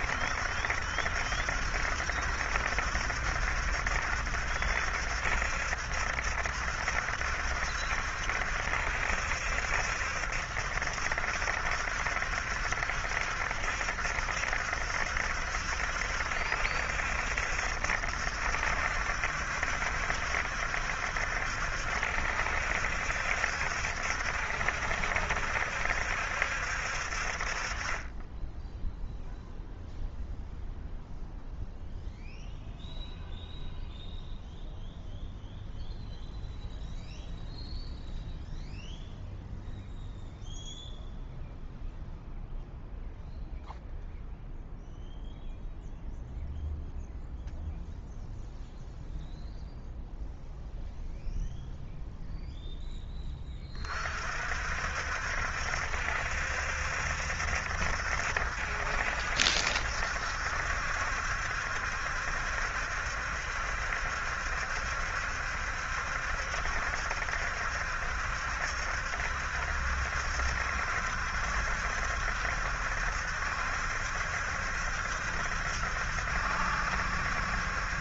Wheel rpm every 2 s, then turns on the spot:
70, 70, 70, 70, 70, 70, 70, 70, 70, 70, 70, 70, 70, 60, 0, 0, 0, 0, 0, 0, 0, 0, 0, 0, 0, 0, 0, 60, 70, 70, 70, 70, 70, 70, 70, 70, 70, 70, 70.
none